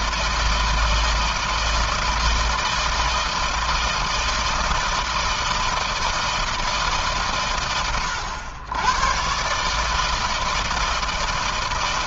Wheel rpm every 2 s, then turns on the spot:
160, 160, 160, 150, 130, 160.
none